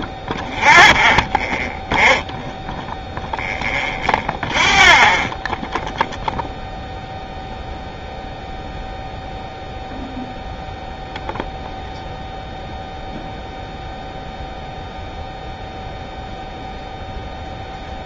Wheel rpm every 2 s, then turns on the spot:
0, 0, 0, 0, 0, 0, 0, 0, 0.
none